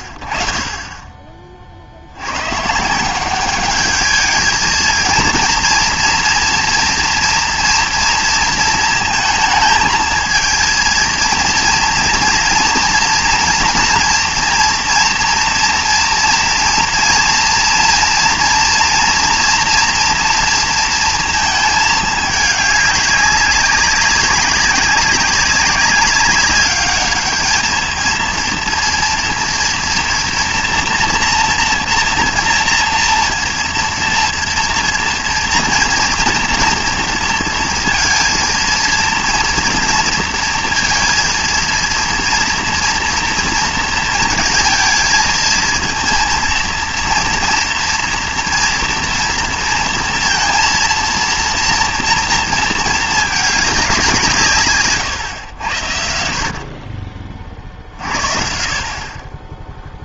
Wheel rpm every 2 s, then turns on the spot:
30, 150, 220, 240, 230, 230, 230, 240, 230, 230, 230, 210, 190, 200, 230, 230, 230, 230, 230, 230, 230, 230, 230, 230, 230, 230, 220, 150, 50, 50.
none